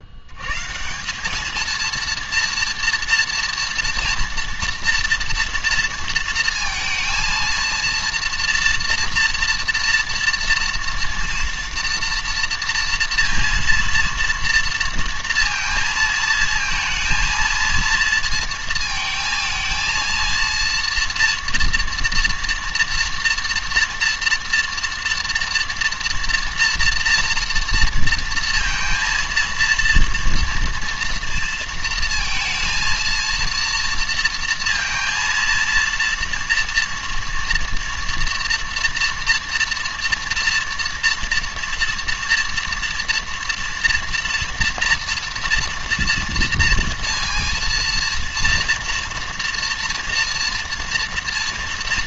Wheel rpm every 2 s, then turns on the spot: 150, 230, 230, 230, 230, 230, 230, 230, 230, 220, 230, 240, 230, 230, 230, 230, 230, 230, 230, 230, 230, 230, 230, 230, 230, 240.
none